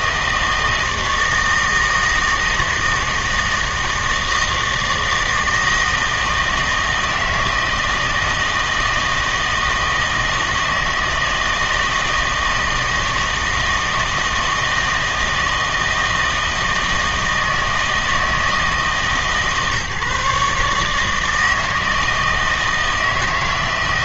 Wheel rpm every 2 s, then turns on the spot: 160, 160, 160, 160, 160, 160, 160, 160, 160, 160, 150, 160.
none